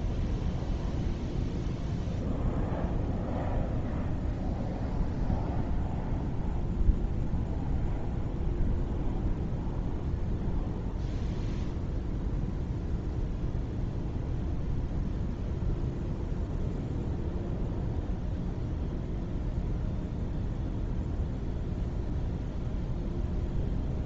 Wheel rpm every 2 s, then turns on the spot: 0, 0, 0, 0, 0, 0, 0, 0, 0, 0, 0, 0.
none